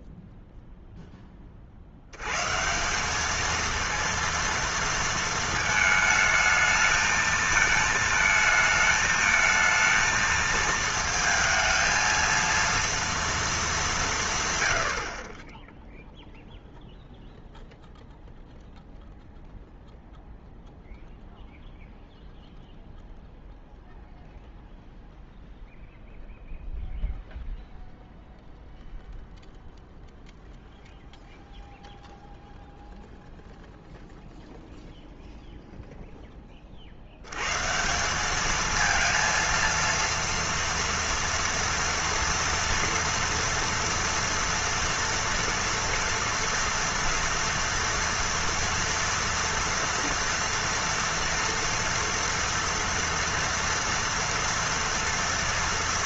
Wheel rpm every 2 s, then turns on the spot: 0, 150, 230, 220, 220, 220, 230, 110, 0, 0, 0, 0, 0, 0, 0, 0, 0, 0, 30, 220, 230, 240, 230, 230, 230, 230, 230, 230.
none